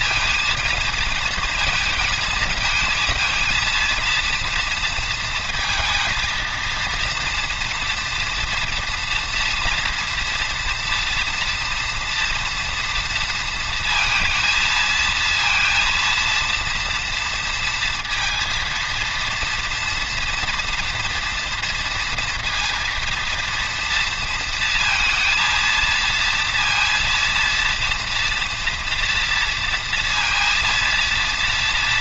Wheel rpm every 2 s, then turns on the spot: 230, 220, 230, 230, 230, 230, 240, 230, 230, 230, 230, 240, 230, 230, 230, 230.
none